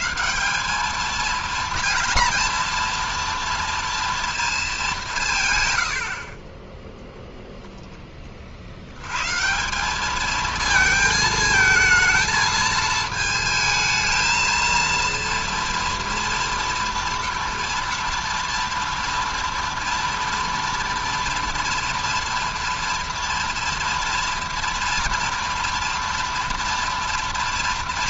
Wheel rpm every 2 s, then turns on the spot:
180, 230, 230, 30, 40, 220, 220, 230, 230, 230, 230, 230, 230, 230.
none